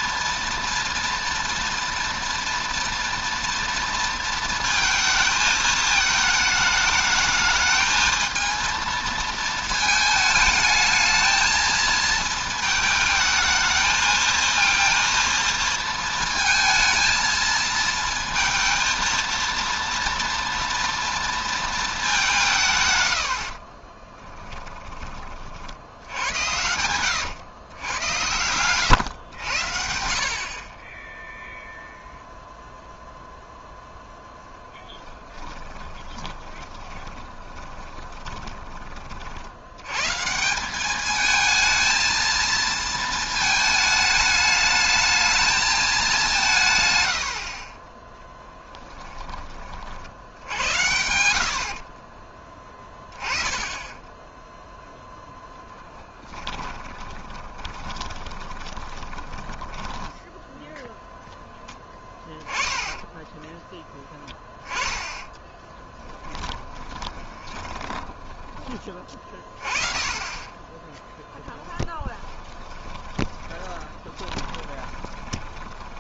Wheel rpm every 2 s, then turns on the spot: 230, 230, 230, 220, 230, 220, 230, 230, 230, 230, 230, 150, 20, 110, 110, 30, 0, 10, 20, 30, 180, 230, 210, 140, 10, 90, 20, 0, 10, 30, 10, 20, 10, 20, 20, 20, 20, 20.
34-38 48-50 56-60 62-68 72-76